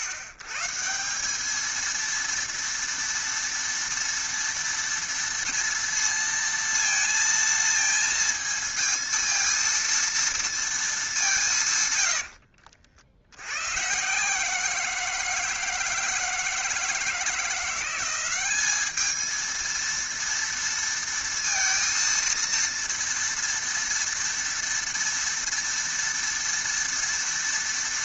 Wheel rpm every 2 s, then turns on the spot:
130, 230, 230, 230, 230, 230, 60, 160, 160, 200, 230, 230, 230, 230.
12-14